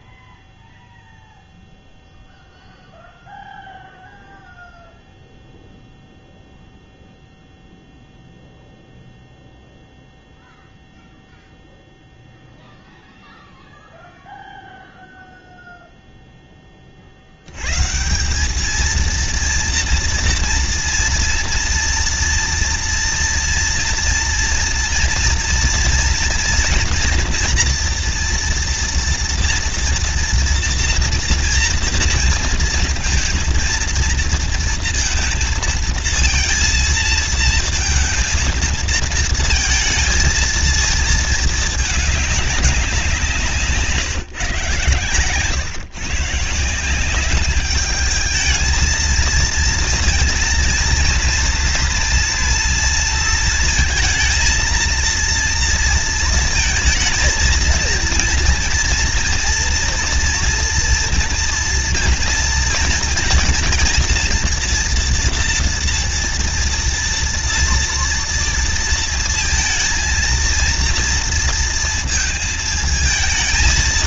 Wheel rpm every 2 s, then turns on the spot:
0, 0, 0, 0, 0, 0, 0, 0, 0, 180, 230, 230, 230, 230, 230, 230, 230, 230, 220, 230, 230, 200, 150, 160, 220, 230, 230, 230, 230, 230, 240, 230, 230, 240, 230, 230, 220.
none